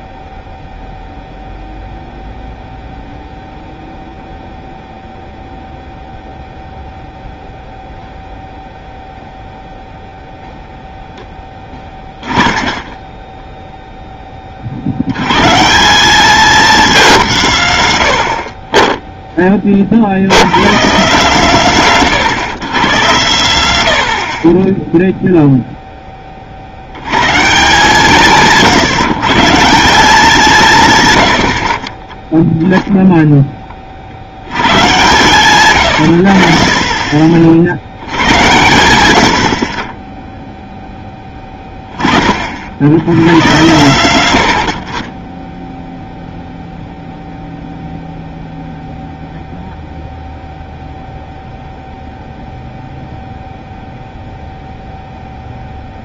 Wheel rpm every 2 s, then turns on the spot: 0, 0, 0, 0, 0, 0, 10, 30, 210, 50, 110, 120, 30, 40, 150, 160, 0, 100, 60, 120, 0, 50, 80, 0, 0, 0, 0, 0.
none